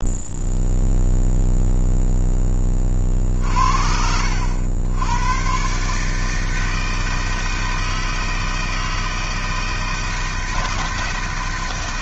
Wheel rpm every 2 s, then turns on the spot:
0, 10, 80, 150, 160, 160.
none